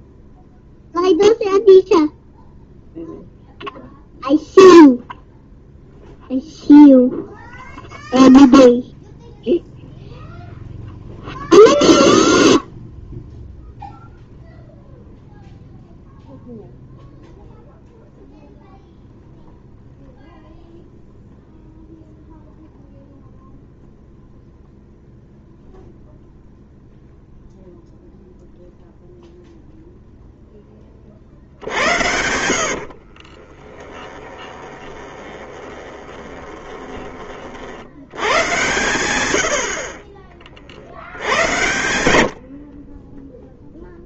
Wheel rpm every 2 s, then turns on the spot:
0, 0, 0, 0, 0, 0, 0, 0, 0, 0, 0, 0, 0, 0, 0, 10, 70, 20, 20, 120, 60, 60.
32-38